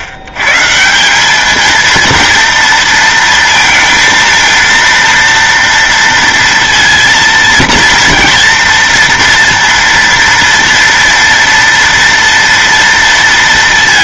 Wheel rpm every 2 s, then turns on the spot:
100, 230, 230, 230, 230, 230, 230.
none